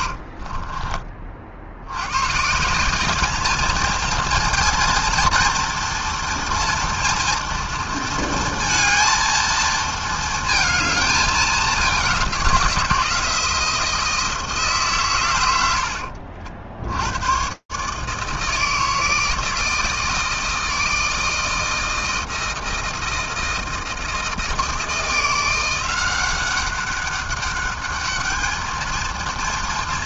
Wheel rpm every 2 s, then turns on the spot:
50, 130, 230, 230, 230, 230, 190, 160, 60, 160, 160, 160, 160, 190, 210.
0-2